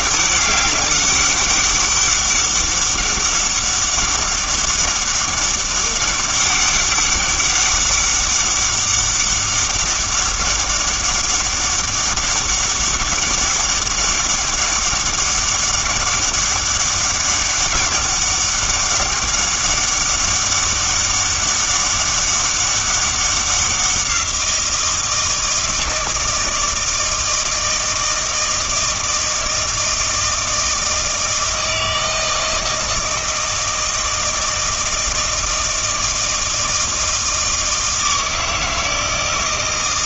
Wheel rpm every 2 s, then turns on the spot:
190, 200, 200, 200, 200, 200, 200, 200, 200, 200, 200, 200, 170, 160, 160, 160, 160, 160, 160, 160.
none